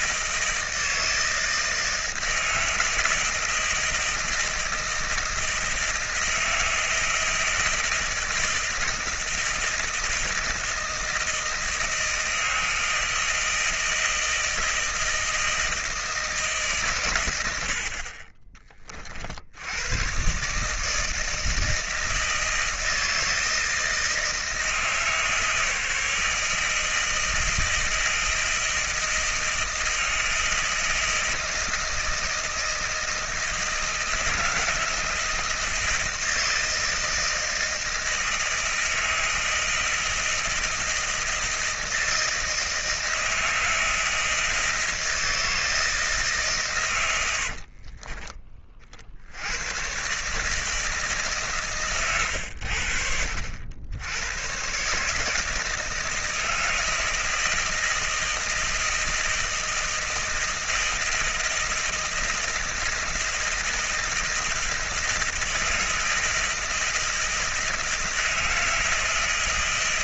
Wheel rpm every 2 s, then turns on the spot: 160, 160, 160, 160, 160, 160, 160, 160, 130, 40, 150, 160, 160, 160, 160, 160, 160, 160, 160, 160, 160, 160, 160, 130, 40, 150, 70, 130, 160, 160, 160, 160, 160, 160, 160.
none